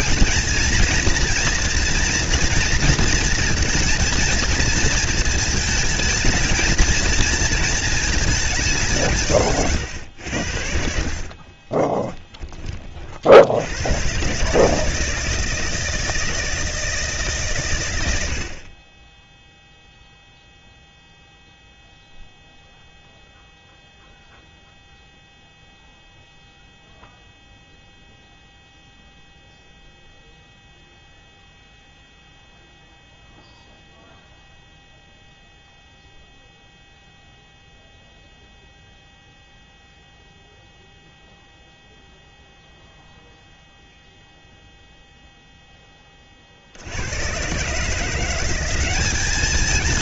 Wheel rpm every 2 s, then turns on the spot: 230, 230, 230, 220, 200, 70, 20, 140, 160, 70, 0, 0, 0, 0, 0, 0, 0, 0, 0, 0, 0, 0, 0, 50, 180.
none